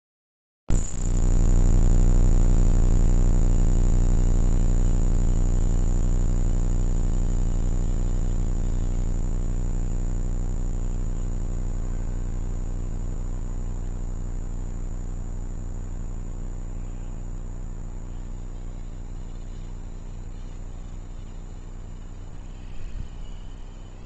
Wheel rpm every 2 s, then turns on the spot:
0, 0, 0, 0, 0, 0, 0, 0, 0, 0, 0, 0.
none